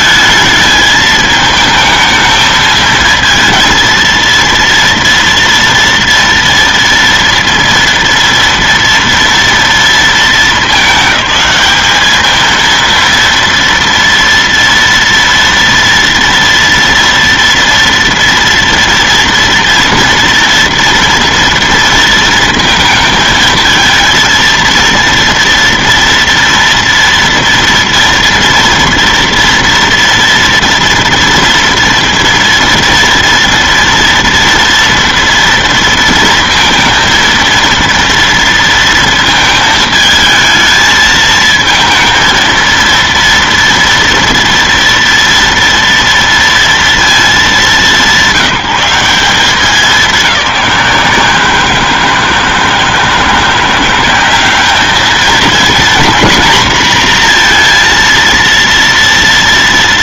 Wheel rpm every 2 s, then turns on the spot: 220, 220, 230, 230, 230, 200, 230, 230, 230, 230, 230, 220, 230, 230, 230, 230, 230, 230, 230, 230, 220, 230, 230, 230, 190, 180, 160, 210, 250, 230.
none